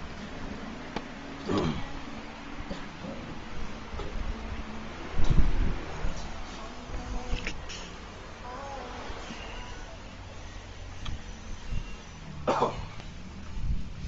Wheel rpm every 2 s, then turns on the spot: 0, 0, 0, 0, 0, 0, 0.
none